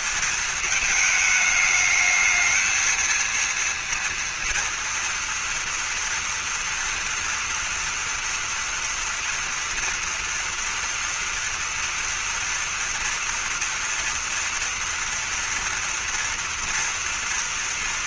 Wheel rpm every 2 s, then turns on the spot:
220, 220, 240, 230, 230, 230, 230, 230, 230.
none